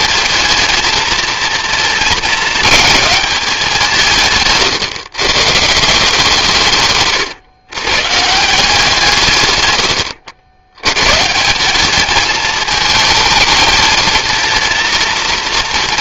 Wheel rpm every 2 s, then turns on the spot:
230, 220, 140, 160, 160, 80, 220, 230.
4-6